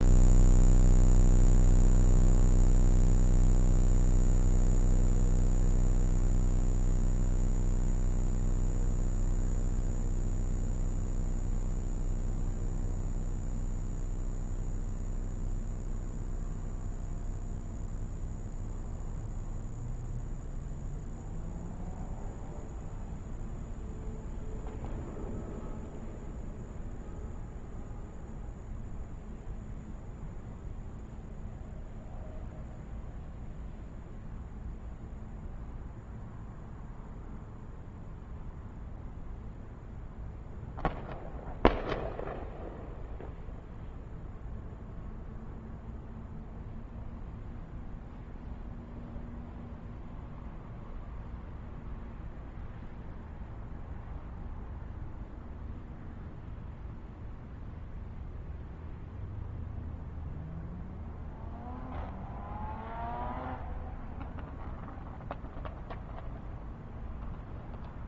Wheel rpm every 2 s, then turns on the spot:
0, 0, 0, 0, 0, 0, 0, 0, 0, 0, 0, 0, 0, 0, 0, 0, 0, 0, 0, 0, 0, 0, 0, 0, 0, 0, 0, 0, 0, 0, 0, 0, 0, 0.
none